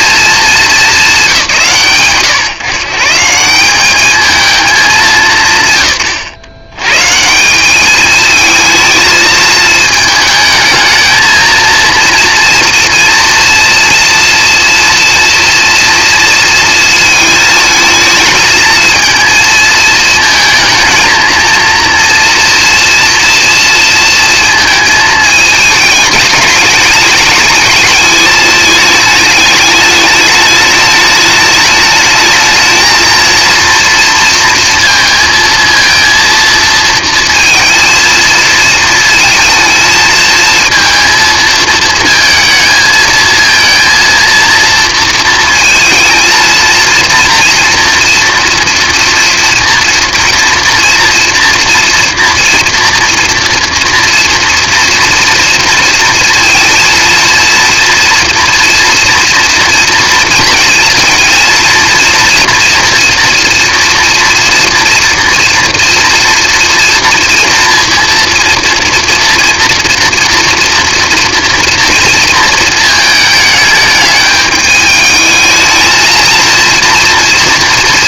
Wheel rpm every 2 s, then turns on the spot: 230, 120, 200, 110, 220, 220, 240, 240, 230, 220, 220, 230, 230, 210, 210, 210, 220, 230, 230, 230, 230, 220, 230, 230, 230, 240, 230, 240, 230, 230, 230, 230, 230, 230, 230, 230, 230, 210, 230.
none